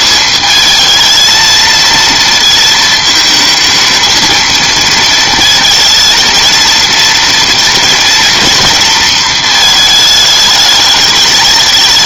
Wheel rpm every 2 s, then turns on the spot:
220, 220, 230, 230, 230, 210.
none